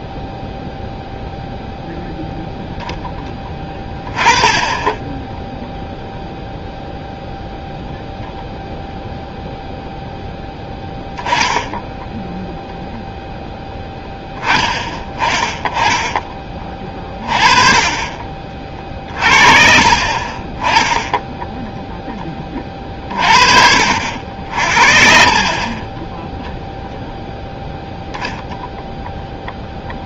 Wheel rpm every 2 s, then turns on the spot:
0, 0, 20, 0, 0, 10, 0, 20, 20, 40, 20, 30, 50, 0, 0.
none